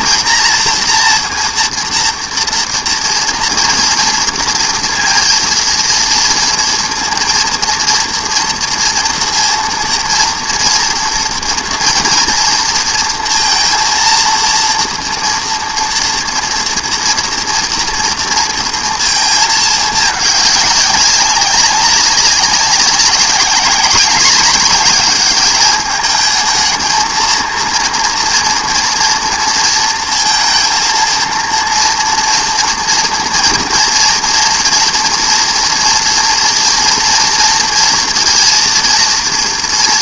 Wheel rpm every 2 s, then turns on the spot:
240, 230, 230, 230, 230, 230, 240, 230, 230, 230, 210, 190, 200, 210, 230, 230, 230, 230, 230, 230.
none